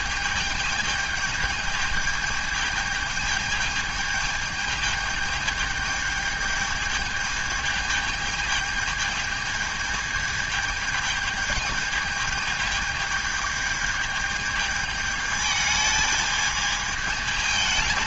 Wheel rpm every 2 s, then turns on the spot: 220, 210, 220, 220, 220, 220, 210, 220, 220.
none